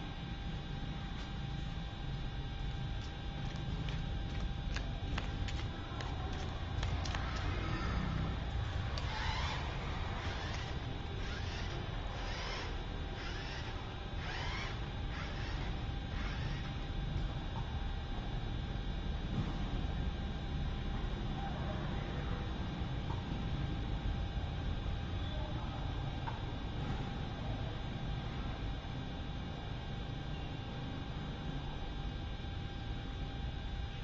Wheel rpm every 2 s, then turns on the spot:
0, 0, 0, 0, 0, 0, 0, 0, 0, 0, 0, 0, 0, 0, 0, 0, 0.
none